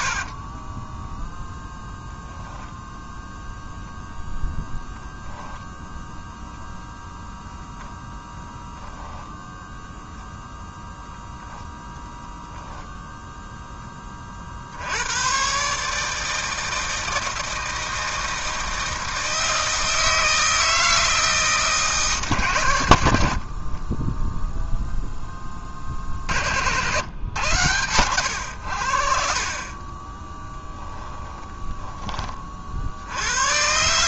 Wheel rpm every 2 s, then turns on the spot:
20, 0, 0, 0, 0, 10, 10, 80, 160, 160, 160, 100, 0, 80, 80, 20, 50.
0-2 30-32